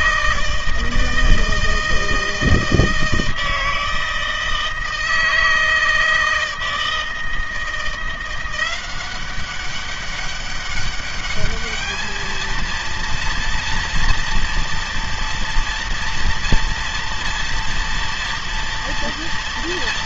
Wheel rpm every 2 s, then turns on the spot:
160, 160, 160, 160, 180, 200, 230, 230, 240, 230.
none